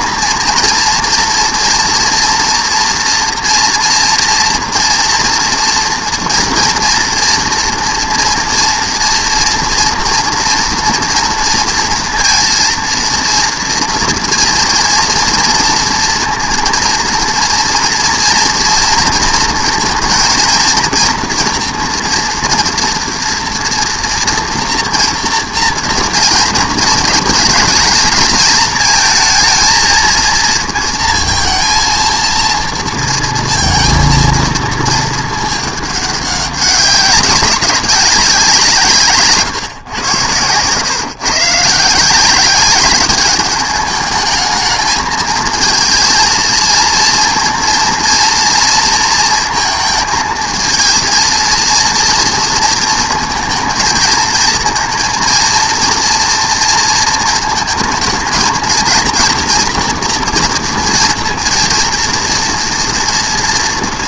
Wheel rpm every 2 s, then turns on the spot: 230, 230, 230, 230, 230, 230, 230, 230, 230, 230, 230, 240, 240, 230, 220, 230, 230, 230, 200, 180, 110, 190, 220, 230, 230, 220, 230, 230, 230, 230, 240, 230.
none